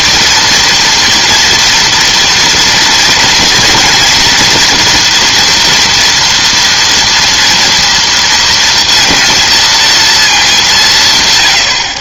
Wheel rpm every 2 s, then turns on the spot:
230, 230, 230, 230, 230, 200.
none